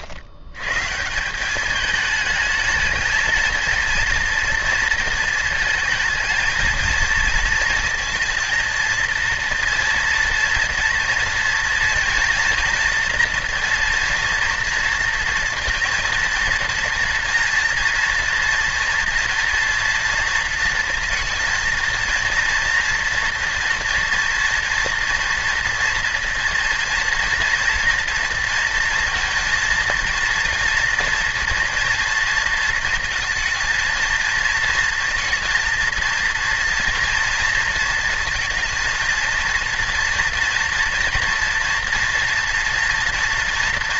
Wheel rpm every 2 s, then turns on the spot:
140, 220, 230, 230, 230, 230, 230, 230, 230, 230, 230, 230, 240, 240, 230, 230, 230, 230, 230, 230, 230, 240.
none